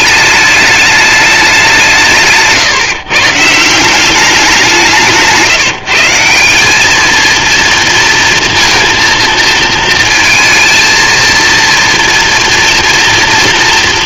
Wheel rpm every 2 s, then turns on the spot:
210, 140, 160, 230, 230, 230, 230.
none